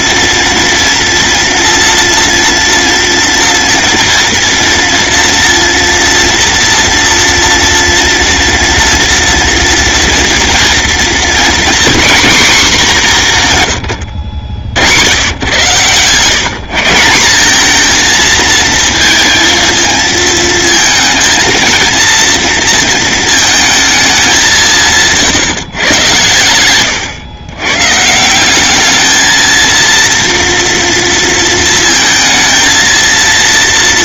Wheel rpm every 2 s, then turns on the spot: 230, 230, 230, 230, 230, 240, 200, 90, 170, 230, 230, 230, 160, 110, 210, 230, 230.
none